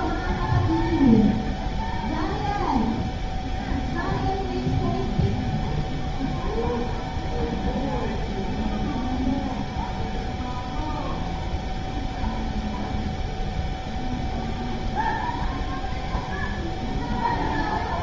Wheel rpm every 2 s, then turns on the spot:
0, 0, 0, 0, 0, 0, 0, 0, 0.
none